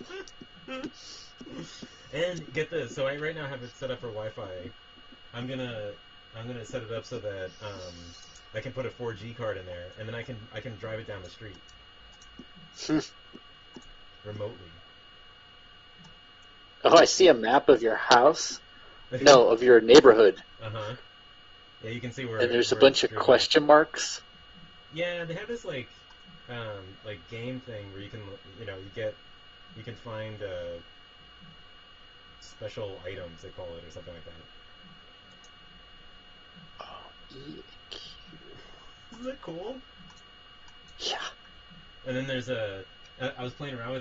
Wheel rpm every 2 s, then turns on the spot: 0, 0, 0, 0, 0, 0, 0, 0, 0, 0, 0, 0, 0, 0, 0, 0, 0, 0, 0, 0, 0, 0.
none